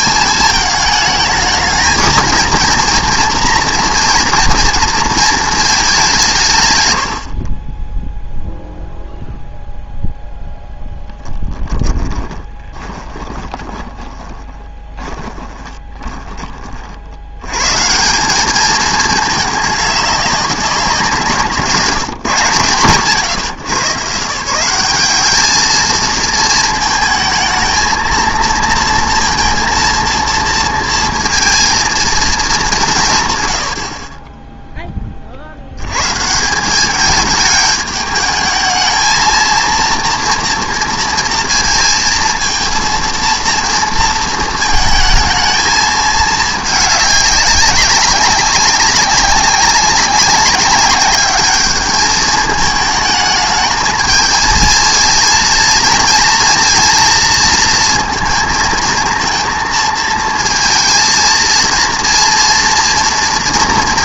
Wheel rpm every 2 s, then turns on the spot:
220, 230, 230, 130, 0, 0, 20, 10, 40, 200, 190, 140, 170, 220, 230, 230, 200, 10, 180, 220, 230, 230, 220, 210, 190, 190, 220, 220, 230, 230, 230, 230.
12-16